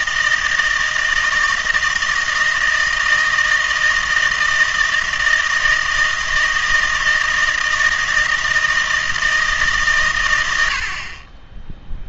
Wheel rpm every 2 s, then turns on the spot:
160, 160, 160, 160, 160, 80.
none